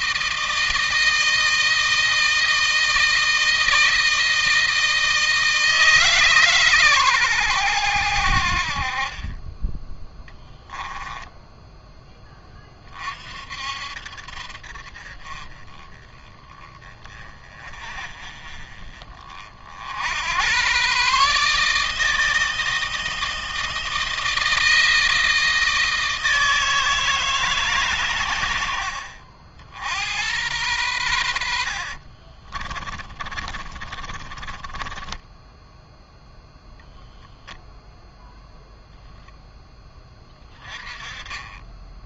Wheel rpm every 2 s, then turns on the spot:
160, 160, 160, 130, 40, 10, 30, 50, 20, 30, 120, 160, 160, 160, 70, 100, 30, 20, 0, 0, 20.
10-12 32-36